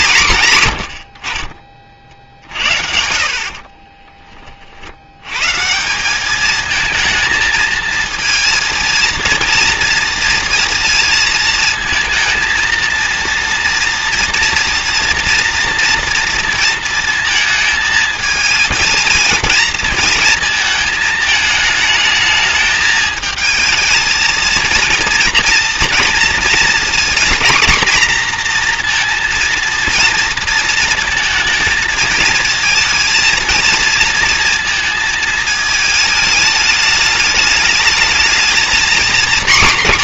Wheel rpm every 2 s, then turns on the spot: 100, 60, 50, 220, 230, 230, 230, 230, 230, 230, 220, 220, 230, 240, 240, 220, 220, 220, 210, 240.
none